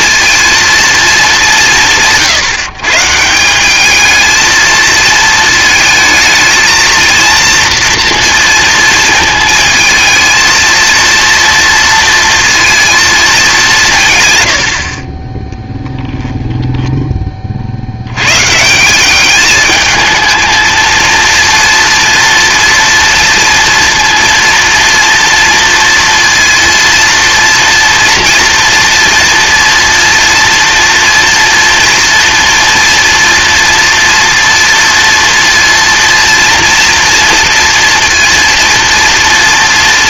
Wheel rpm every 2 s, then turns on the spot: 230, 160, 220, 230, 230, 220, 230, 90, 0, 150, 220, 230, 230, 230, 240, 230, 240, 230, 240, 240.
none